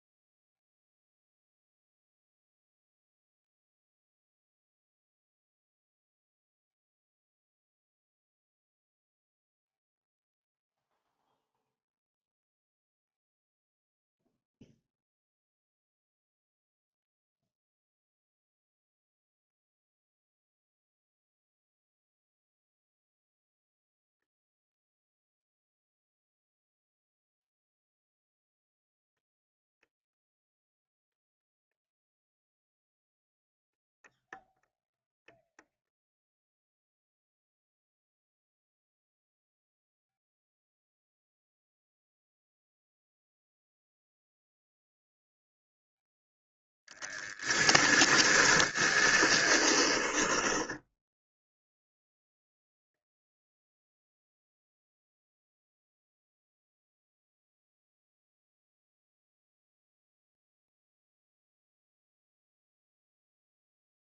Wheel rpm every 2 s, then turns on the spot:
0, 0, 0, 0, 0, 0, 0, 0, 0, 0, 0, 0, 0, 0, 0, 0, 0, 0, 0, 0, 0, 0, 0, 0, 10, 10, 0, 0, 0, 0, 0, 0.
48-52